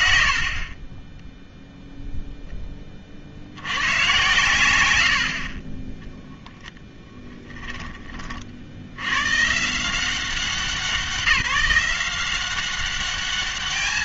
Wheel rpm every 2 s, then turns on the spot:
20, 60, 60, 10, 90, 170, 200.
0-2 4-8